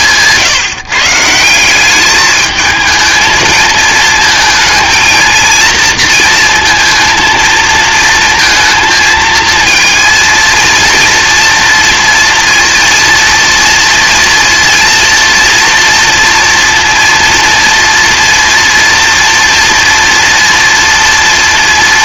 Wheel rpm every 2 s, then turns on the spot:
140, 210, 220, 230, 230, 230, 230, 240, 230, 230, 230.
none